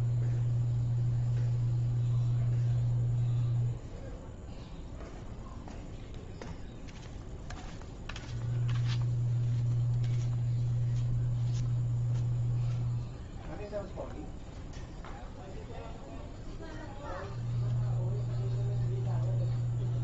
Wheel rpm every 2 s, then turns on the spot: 0, 0, 0, 0, 0, 0, 0, 0, 0, 0.
none